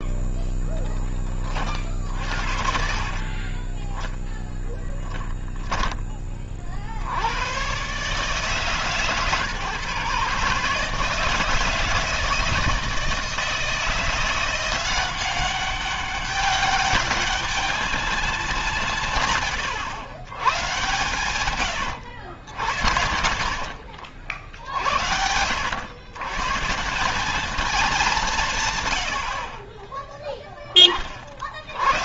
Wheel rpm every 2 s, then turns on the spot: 10, 60, 10, 50, 140, 150, 160, 180, 200, 180, 130, 80, 60, 160, 130, 20.
4-6